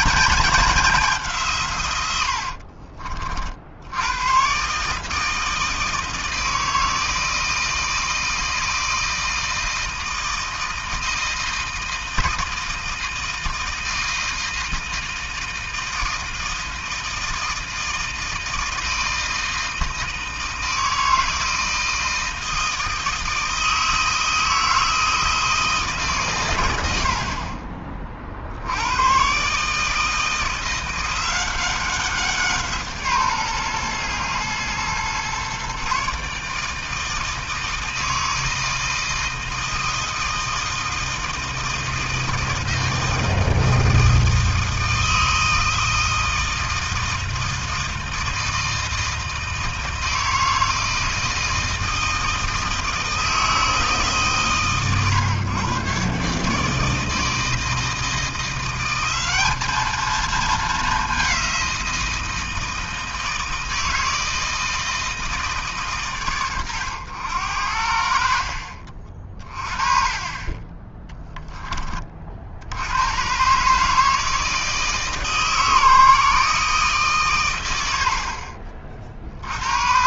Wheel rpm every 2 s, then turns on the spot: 210, 50, 130, 160, 160, 160, 160, 160, 160, 160, 160, 160, 160, 100, 80, 170, 160, 120, 150, 160, 160, 160, 160, 160, 160, 160, 160, 130, 150, 180, 220, 160, 160, 100, 50, 20, 70, 160, 150, 50.
2-4